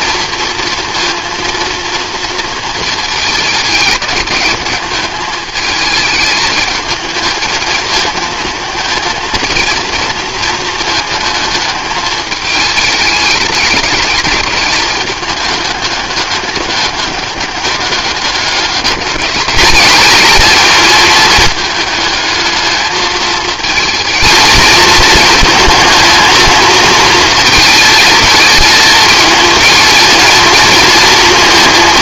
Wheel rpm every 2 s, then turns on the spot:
230, 230, 210, 220, 220, 220, 210, 210, 200, 200, 220, 220, 230, 230, 220, 230.
none